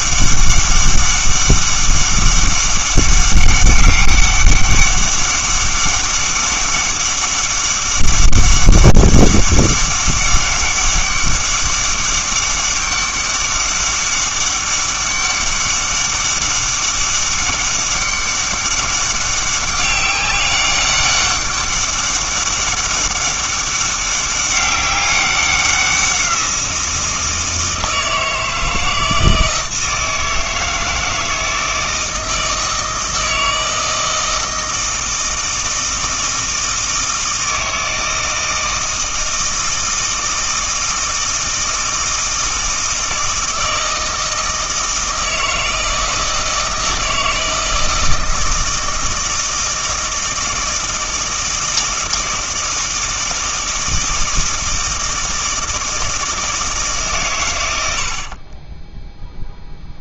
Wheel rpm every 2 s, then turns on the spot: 200, 200, 200, 200, 200, 200, 200, 200, 200, 200, 200, 200, 200, 170, 160, 160, 160, 160, 160, 160, 160, 160, 160, 160, 160, 160, 160, 160, 160, 20.
58-60